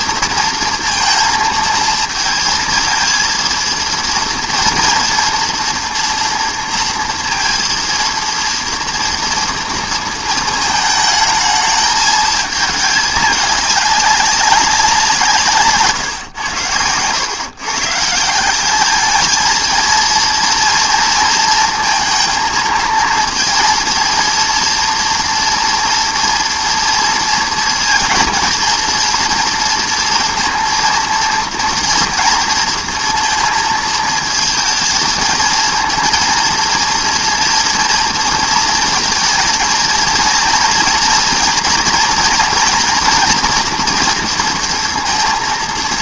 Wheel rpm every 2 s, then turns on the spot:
230, 230, 230, 230, 230, 220, 220, 190, 120, 170, 230, 230, 230, 240, 230, 230, 230, 230, 230, 230, 230, 240, 230.
none